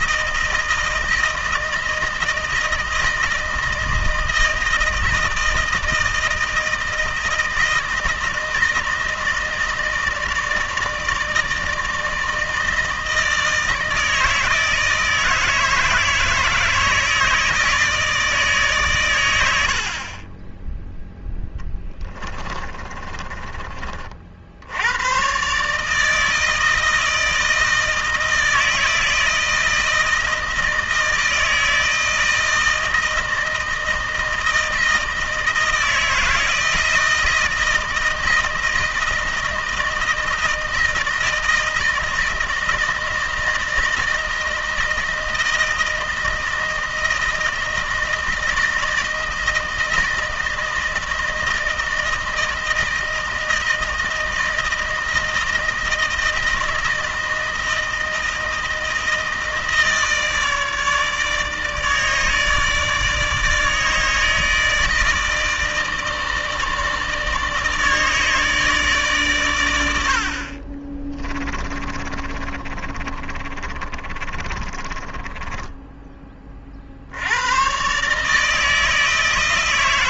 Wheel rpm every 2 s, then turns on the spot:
160, 160, 160, 160, 160, 160, 160, 160, 160, 150, 30, 30, 70, 160, 160, 160, 160, 160, 160, 160, 160, 160, 160, 160, 160, 160, 160, 160, 160, 160, 150, 150, 160, 150, 150, 50, 30, 30, 20, 150.
20-24 72-76